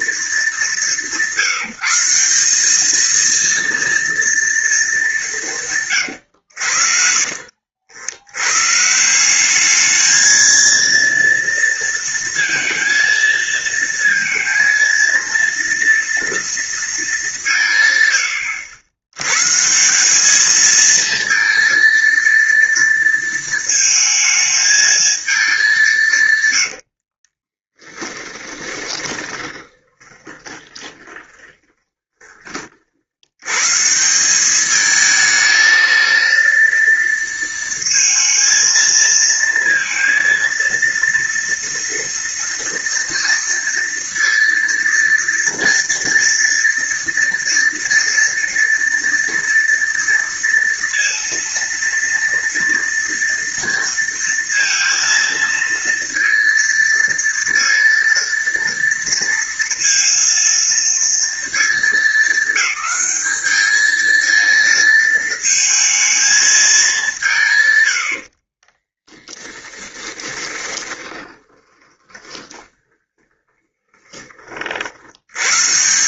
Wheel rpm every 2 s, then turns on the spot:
210, 190, 230, 110, 110, 220, 230, 230, 230, 100, 210, 230, 220, 120, 20, 30, 40, 200, 230, 230, 230, 230, 230, 230, 230, 230, 230, 230, 230, 230, 230, 210, 220, 220, 60, 20, 20, 40.
6-8 28-32 68-74